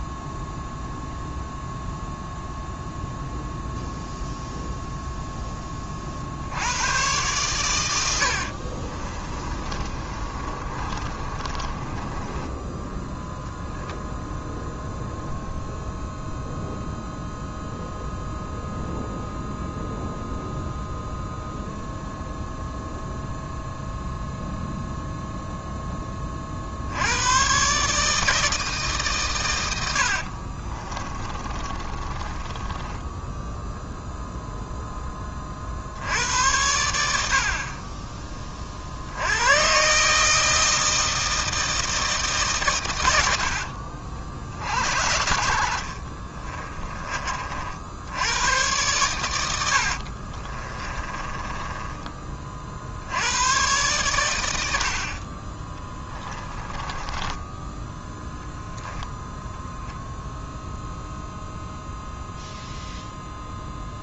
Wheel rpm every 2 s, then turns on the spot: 0, 0, 0, 110, 40, 30, 10, 0, 0, 0, 0, 0, 0, 70, 150, 30, 20, 10, 80, 60, 160, 120, 60, 30, 110, 30, 50, 70, 20, 0, 0, 0.
8-12 30-34 46-48 50-52 56-58